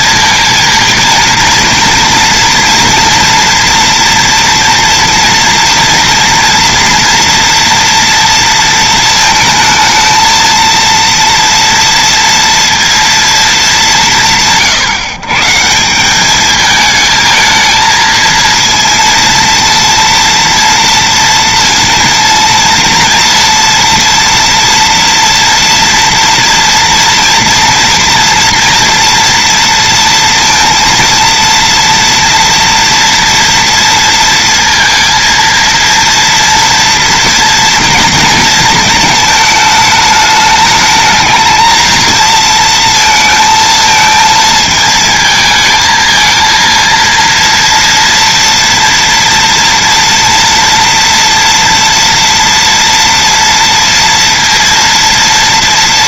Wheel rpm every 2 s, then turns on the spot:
220, 230, 230, 230, 230, 230, 230, 150, 210, 230, 230, 230, 240, 230, 230, 230, 230, 230, 230, 230, 210, 230, 220, 230, 230, 230, 240, 230.
none